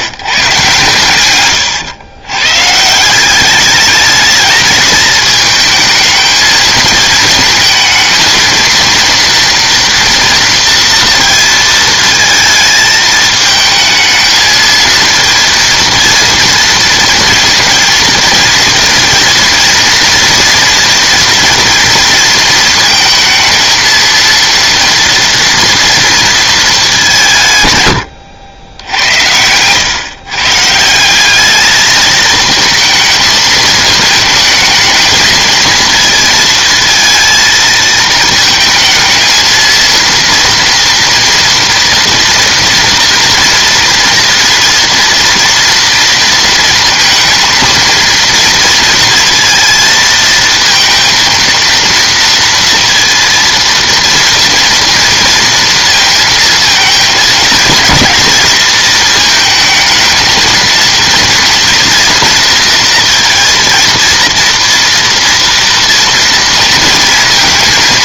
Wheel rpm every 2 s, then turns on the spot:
140, 140, 220, 220, 230, 230, 220, 220, 230, 230, 240, 220, 230, 210, 90, 150, 220, 220, 230, 220, 230, 230, 230, 230, 230, 230, 230, 230, 230, 220, 230, 230, 230, 230.
none